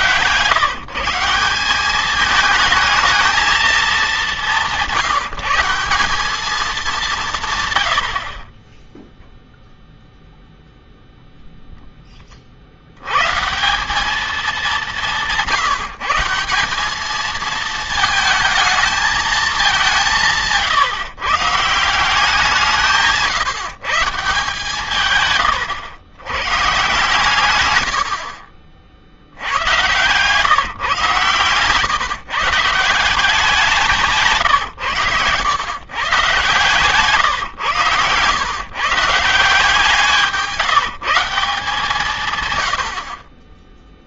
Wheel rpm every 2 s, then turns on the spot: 130, 220, 180, 200, 20, 0, 80, 200, 190, 220, 150, 170, 150, 130, 50, 140, 170, 140, 160, 140, 170, 90.
none